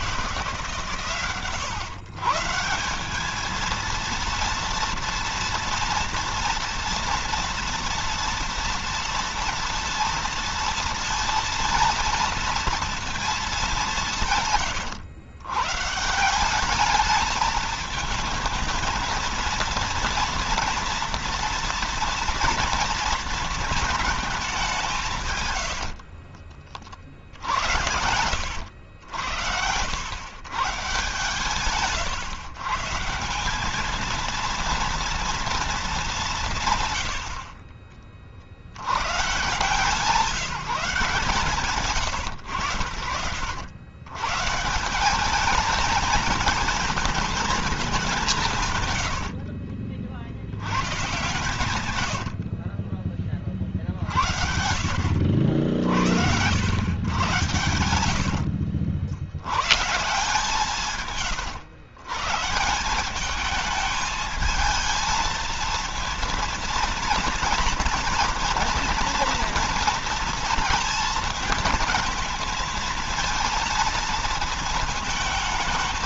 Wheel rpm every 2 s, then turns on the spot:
120, 180, 230, 230, 230, 230, 220, 110, 210, 230, 230, 230, 190, 40, 80, 150, 160, 230, 100, 110, 160, 90, 180, 230, 100, 130, 30, 80, 100, 80, 140, 190, 220, 230, 230, 220, 230, 230.
26-28 52-54